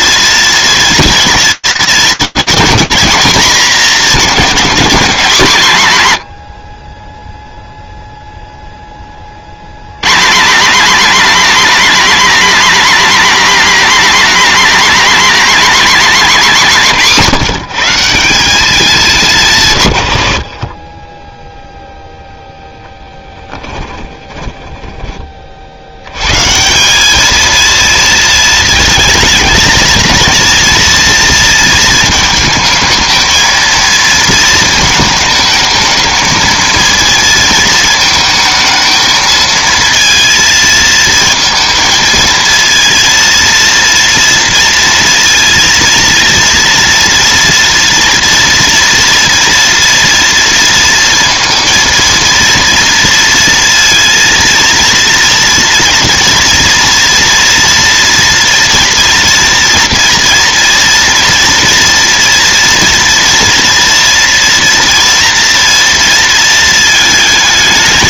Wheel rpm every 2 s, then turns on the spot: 230, 230, 220, 80, 10, 250, 270, 270, 210, 200, 20, 20, 40, 220, 230, 230, 220, 220, 230, 220, 230, 230, 230, 230, 230, 230, 230, 230, 230, 230, 230, 230, 230, 210.
22-24